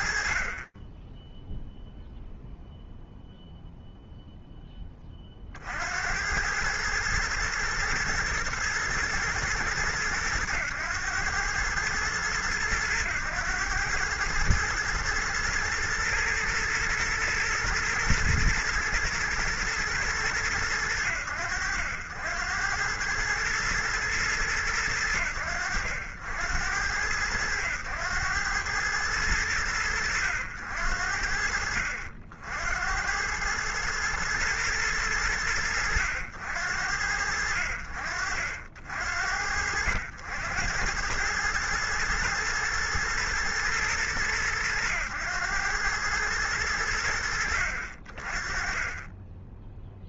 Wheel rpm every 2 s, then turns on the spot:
0, 0, 30, 110, 110, 110, 110, 120, 110, 110, 80, 110, 70, 100, 100, 60, 110, 80, 50, 80, 120, 110, 100, 50, 0.
none